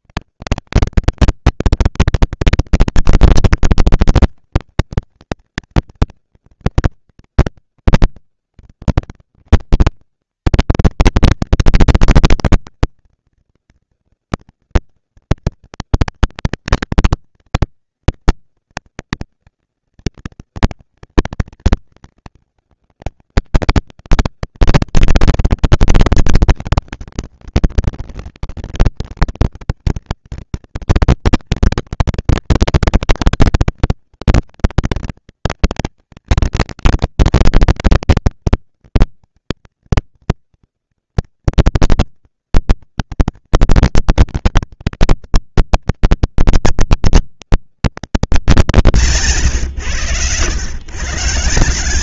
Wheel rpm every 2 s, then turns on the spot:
140, 230, 220, 220, 130, 200, 240, 230, 230, 230, 220, 210, 200, 200, 220, 230, 230, 230, 230, 230, 230, 230, 230, 240, 210, 110.
none